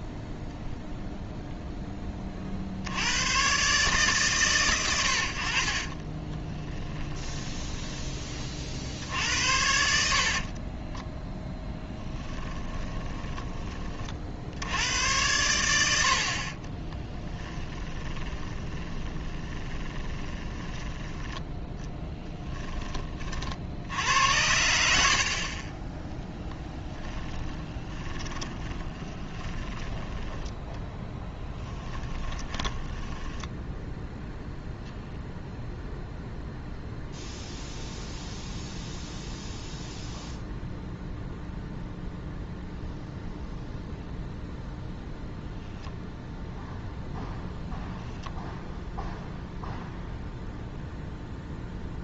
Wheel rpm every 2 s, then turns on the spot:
0, 90, 80, 20, 50, 20, 20, 80, 30, 20, 10, 20, 80, 10, 20, 10, 10, 0, 0, 0, 0, 0, 0, 0, 0, 0.
6-8 10-14 16-22 26-34